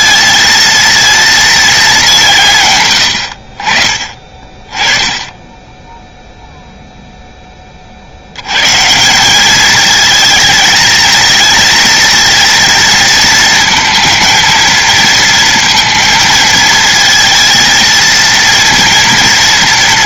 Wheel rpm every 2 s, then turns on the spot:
230, 120, 30, 0, 150, 220, 230, 230, 220, 230.
4-6